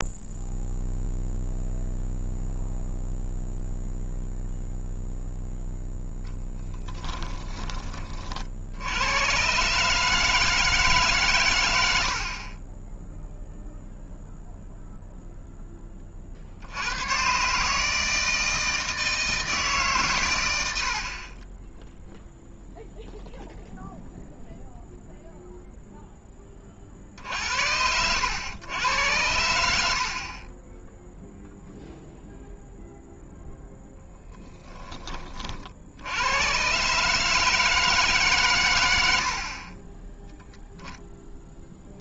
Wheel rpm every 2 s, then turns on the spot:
0, 0, 0, 10, 100, 140, 10, 0, 100, 160, 40, 0, 0, 10, 90, 0, 0, 10, 130, 110, 0.
6-8